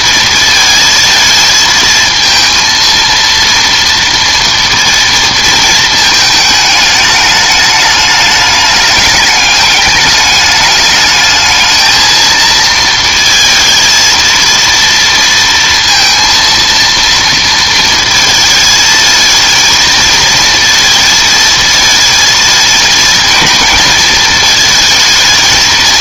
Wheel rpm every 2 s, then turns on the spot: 230, 230, 230, 210, 210, 210, 220, 230, 230, 220, 230, 220, 230.
none